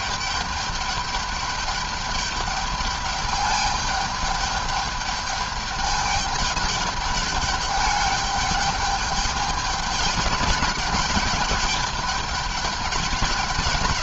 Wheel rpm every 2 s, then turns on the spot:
210, 210, 210, 210, 210, 210, 210.
none